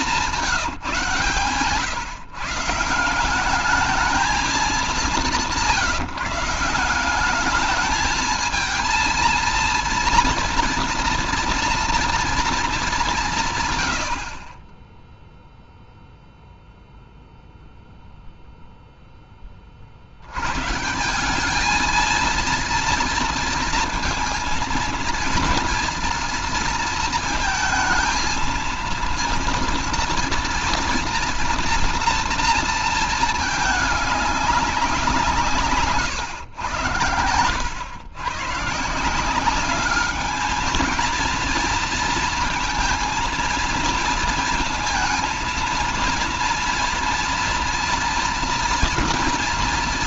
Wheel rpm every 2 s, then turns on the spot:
160, 150, 210, 170, 220, 230, 210, 20, 0, 0, 140, 230, 230, 230, 230, 230, 230, 190, 110, 140, 220, 230, 230, 230, 230.
none